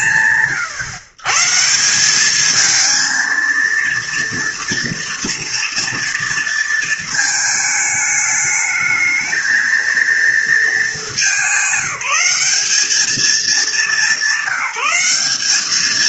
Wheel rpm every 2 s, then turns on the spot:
120, 230, 230, 220, 220, 210, 200, 200.
none